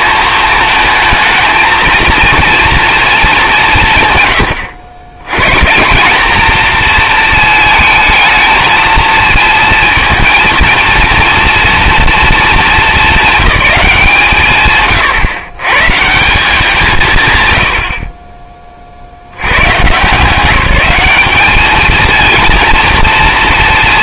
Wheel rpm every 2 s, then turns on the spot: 220, 230, 110, 230, 220, 230, 220, 140, 190, 20, 190, 230.
none